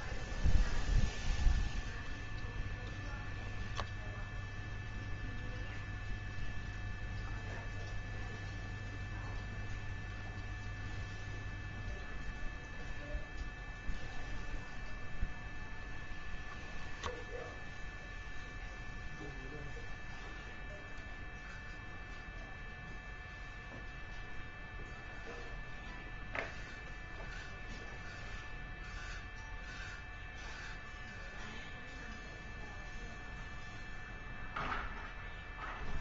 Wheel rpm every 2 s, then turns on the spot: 10, 10, 0, 0, 0, 0, 0, 0, 0, 0, 0, 0, 0, 0, 0, 0, 0, 0.
none